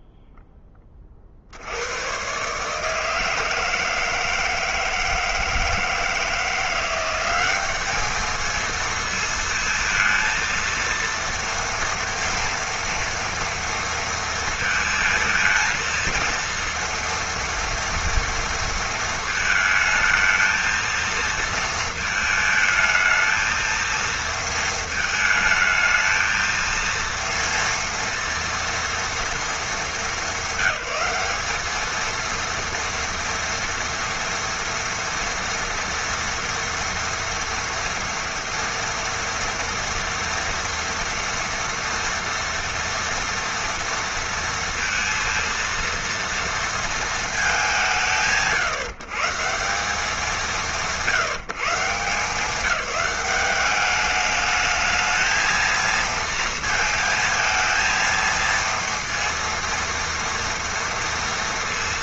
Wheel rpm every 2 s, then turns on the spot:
10, 150, 160, 170, 220, 230, 230, 230, 230, 230, 220, 220, 230, 230, 230, 200, 230, 230, 230, 230, 230, 230, 230, 230, 120, 160, 200, 210, 230, 230, 230.
none